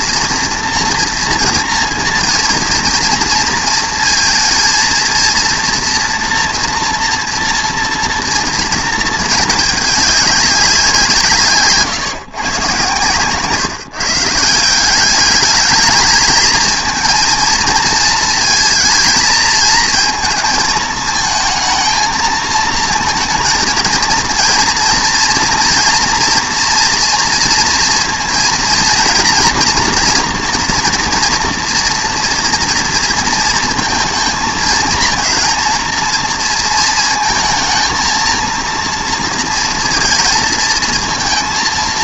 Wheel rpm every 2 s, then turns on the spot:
230, 230, 230, 240, 230, 180, 130, 180, 220, 220, 220, 220, 230, 230, 230, 230, 230, 220, 230, 230, 220.
none